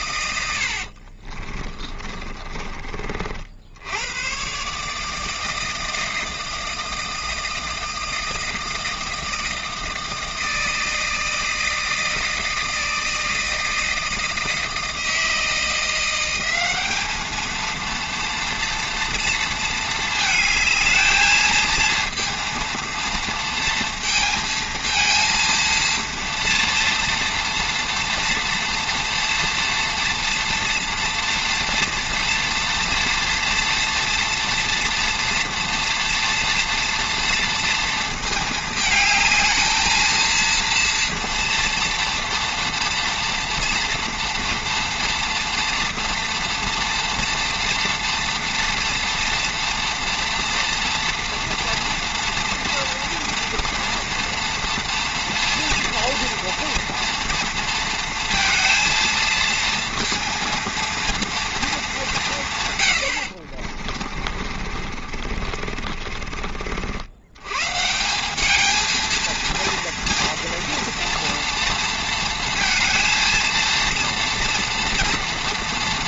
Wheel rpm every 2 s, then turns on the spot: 70, 30, 140, 160, 160, 160, 160, 160, 200, 230, 220, 230, 230, 230, 230, 240, 230, 230, 230, 220, 230, 230, 240, 230, 230, 230, 230, 230, 230, 230, 230, 140, 40, 60, 210, 230, 230, 230.
0-2 64-66